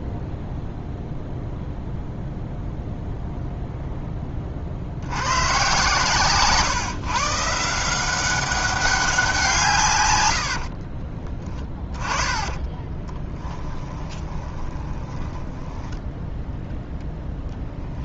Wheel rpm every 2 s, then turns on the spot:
0, 0, 50, 130, 190, 70, 10, 20, 0.
10-16